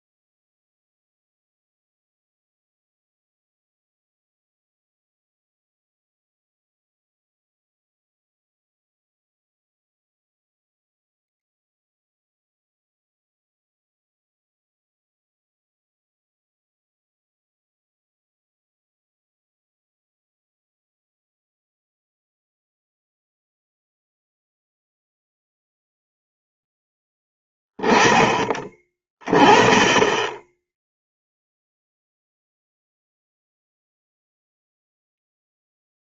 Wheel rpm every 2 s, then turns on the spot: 0, 0, 0, 0, 0, 0, 0, 0, 0, 0, 0, 0, 0, 10, 20, 0, 0, 0.
none